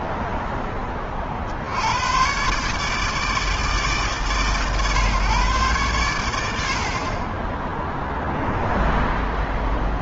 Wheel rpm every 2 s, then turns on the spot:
70, 130, 130, 0, 0.
none